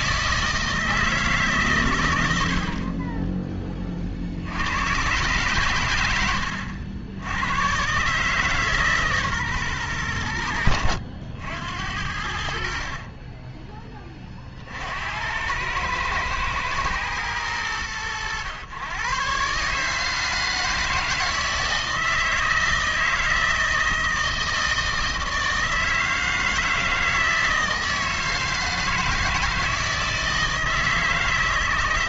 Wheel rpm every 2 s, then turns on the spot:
160, 60, 90, 90, 150, 80, 60, 50, 110, 110, 160, 160, 160, 160, 160, 160.
6-8 12-14